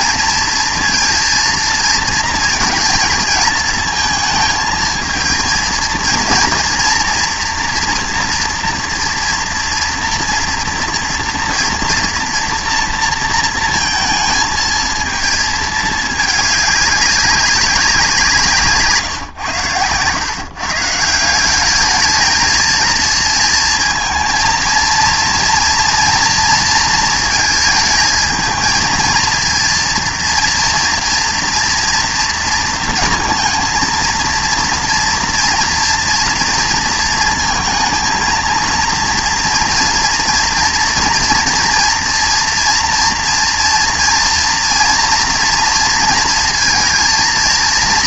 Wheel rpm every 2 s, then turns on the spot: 230, 220, 220, 230, 230, 230, 230, 220, 210, 150, 140, 220, 230, 230, 220, 230, 230, 230, 230, 230, 240, 230, 230, 230.
none